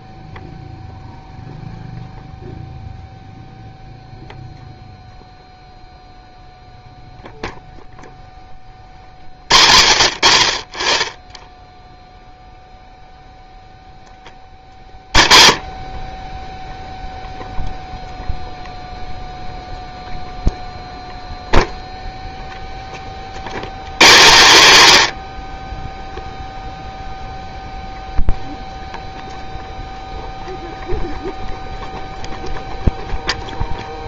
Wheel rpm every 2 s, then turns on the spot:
0, 0, 0, 0, 50, 40, 0, 30, 0, 0, 0, 10, 110, 0, 0, 0, 0.
14-16